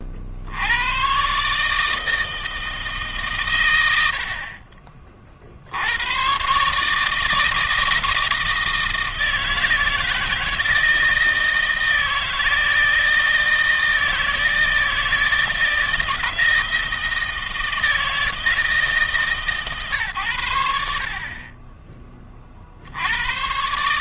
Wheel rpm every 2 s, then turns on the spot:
110, 150, 50, 150, 170, 170, 160, 160, 160, 150, 60, 90.
none